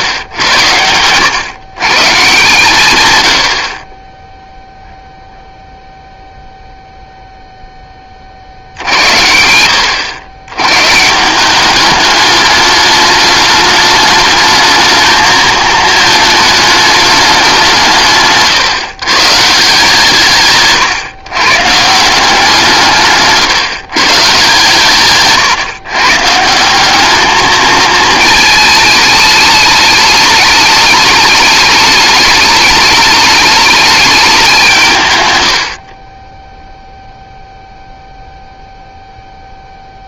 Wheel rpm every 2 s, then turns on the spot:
110, 110, 0, 0, 80, 140, 210, 220, 210, 130, 140, 160, 130, 190, 220, 210, 210, 160, 0, 0.
none